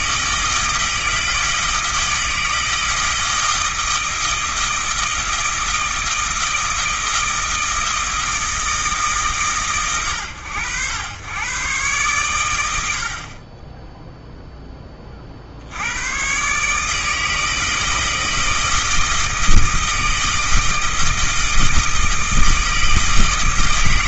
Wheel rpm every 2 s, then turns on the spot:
160, 160, 160, 160, 150, 80, 90, 10, 140, 160, 160, 160.
none